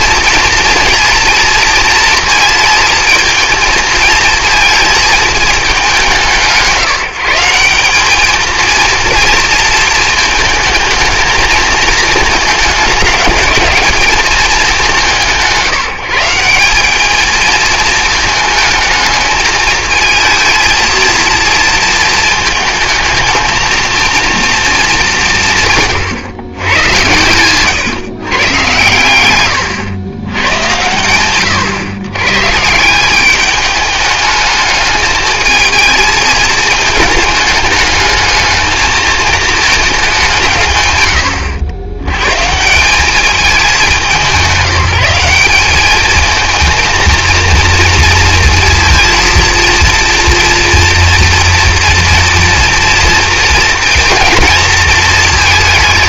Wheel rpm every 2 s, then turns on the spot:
230, 220, 220, 180, 230, 220, 220, 190, 190, 220, 230, 220, 230, 120, 120, 110, 150, 210, 220, 220, 140, 160, 180, 220, 230, 230, 230, 220.
none